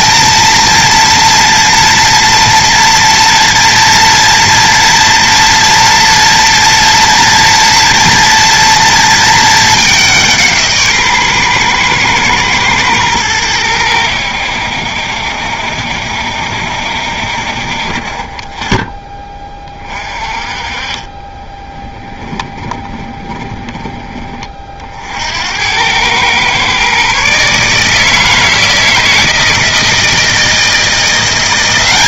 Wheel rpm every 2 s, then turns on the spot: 230, 230, 230, 230, 230, 150, 110, 70, 70, 20, 30, 20, 50, 130, 160, 170.
22-24